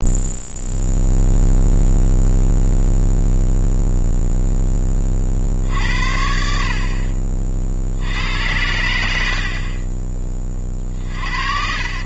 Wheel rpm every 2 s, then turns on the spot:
0, 0, 40, 50, 90, 40.
10-12